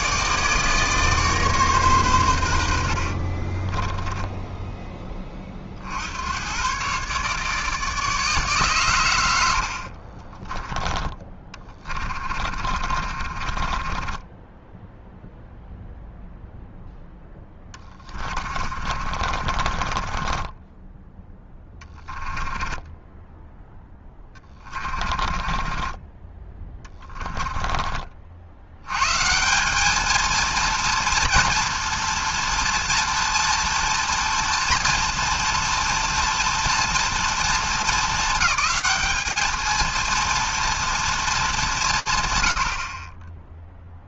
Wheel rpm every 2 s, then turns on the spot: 150, 90, 10, 130, 130, 10, 40, 10, 0, 40, 10, 10, 20, 20, 100, 230, 230, 230, 230, 210, 230, 80.
12-16 18-26